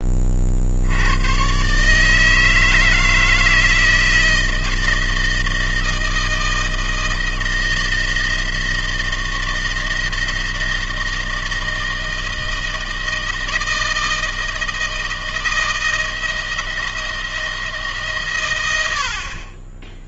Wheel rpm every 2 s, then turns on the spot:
80, 160, 160, 160, 160, 160, 160, 160, 160, 80.
none